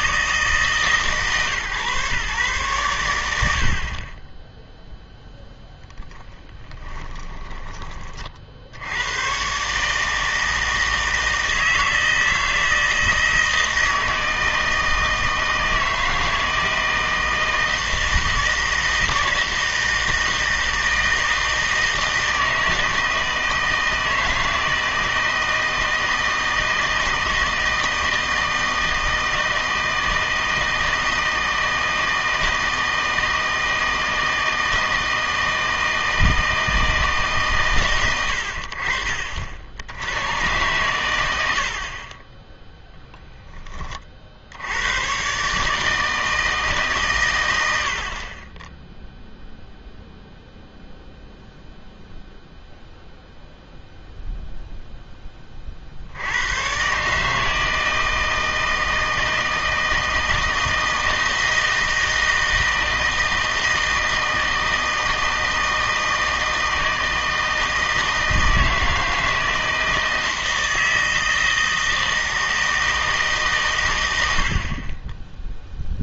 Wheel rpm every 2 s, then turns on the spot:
150, 110, 0, 20, 70, 160, 160, 160, 160, 160, 160, 160, 160, 160, 160, 160, 160, 160, 160, 60, 120, 0, 90, 150, 10, 0, 0, 0, 120, 160, 160, 160, 160, 160, 160, 160, 160, 50.
6-8